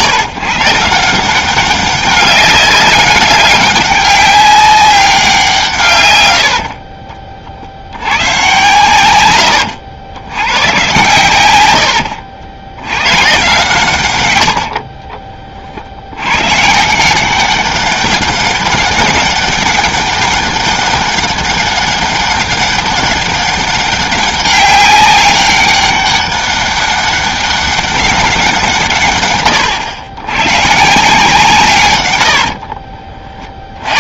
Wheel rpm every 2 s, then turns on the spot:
160, 200, 200, 40, 120, 120, 100, 50, 150, 200, 200, 200, 200, 200, 160, 150, 50.
6-8 14-16 32-34